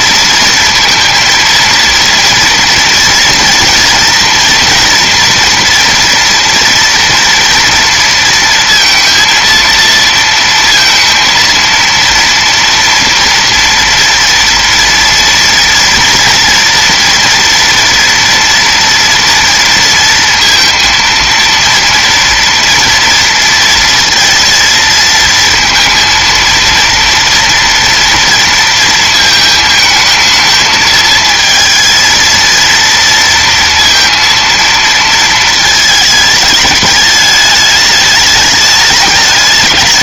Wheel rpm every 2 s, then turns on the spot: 230, 230, 240, 230, 230, 230, 230, 230, 230, 240, 230, 230, 230, 230, 230, 220, 230, 230, 220, 210.
none